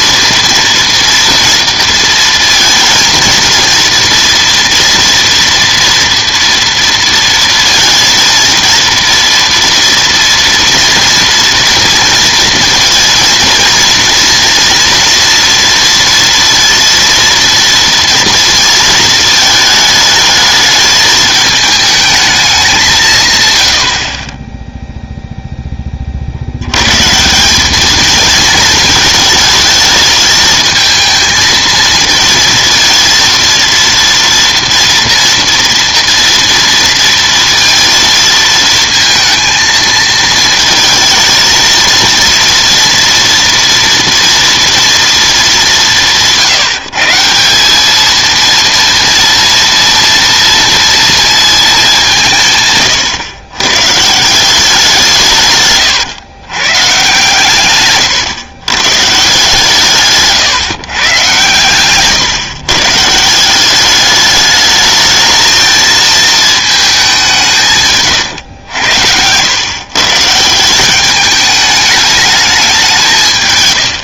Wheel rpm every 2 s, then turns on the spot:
230, 230, 230, 230, 230, 230, 230, 230, 230, 230, 210, 200, 10, 90, 220, 220, 230, 230, 230, 230, 220, 230, 230, 160, 230, 230, 150, 180, 140, 130, 140, 140, 210, 220, 110, 170, 200.
24-26